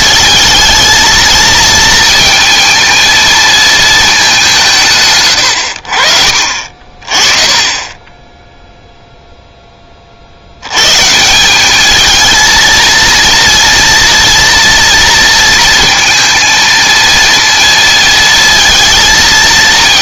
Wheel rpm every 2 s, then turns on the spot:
220, 230, 160, 40, 0, 100, 230, 230, 230, 230.
none